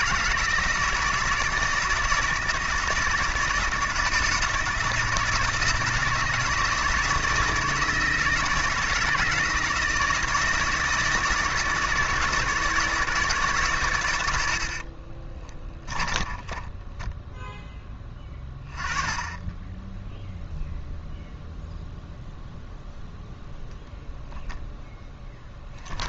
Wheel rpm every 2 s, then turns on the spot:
160, 160, 160, 160, 160, 160, 160, 60, 10, 20, 0, 0, 10.
14-18